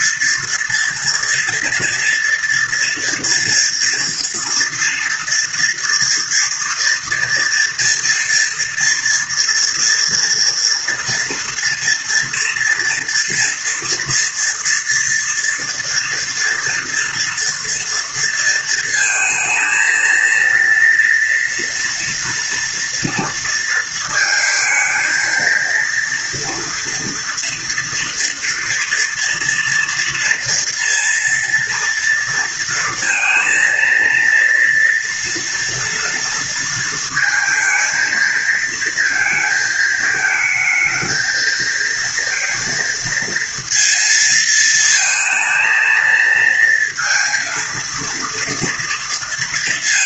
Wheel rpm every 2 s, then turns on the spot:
230, 240, 230, 230, 230, 230, 230, 230, 230, 230, 230, 230, 220, 230, 240, 230, 230, 230, 230, 230, 220, 230, 220, 230, 230.
none